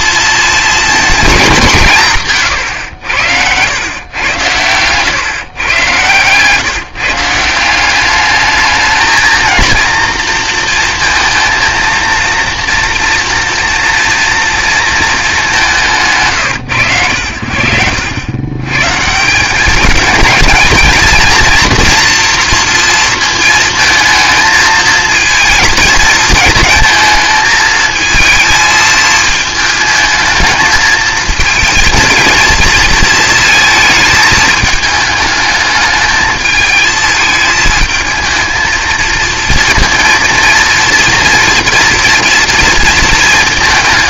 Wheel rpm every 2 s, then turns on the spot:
220, 110, 110, 150, 210, 230, 230, 230, 130, 110, 220, 230, 230, 220, 230, 220, 230, 210, 220, 220, 230, 230.
2-4